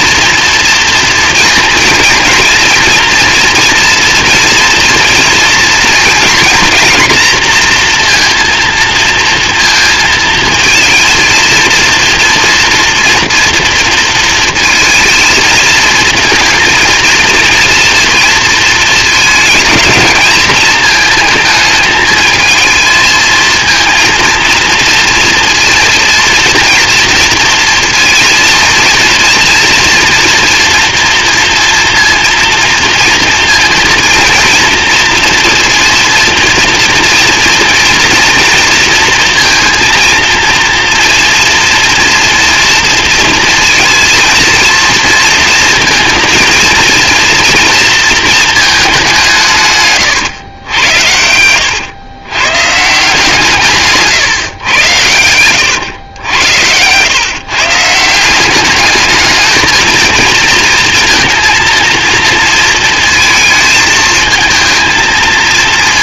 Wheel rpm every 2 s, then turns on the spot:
230, 230, 230, 240, 230, 220, 230, 230, 230, 220, 220, 220, 230, 230, 230, 230, 230, 230, 230, 230, 230, 230, 230, 230, 210, 110, 140, 110, 100, 200, 220, 230, 220.
none